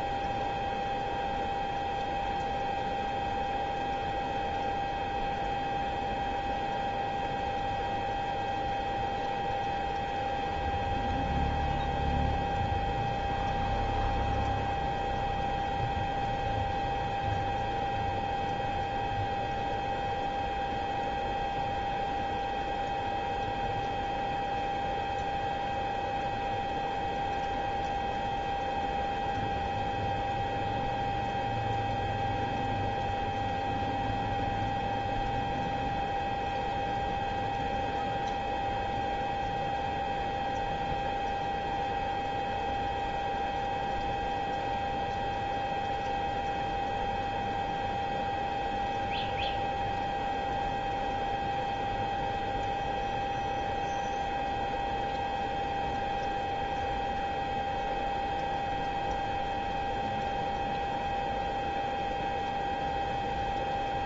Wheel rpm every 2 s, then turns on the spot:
0, 0, 0, 0, 0, 0, 0, 0, 0, 0, 0, 0, 0, 0, 0, 0, 0, 0, 0, 0, 0, 0, 0, 0, 0, 0, 0, 0, 0, 0, 0, 0.
none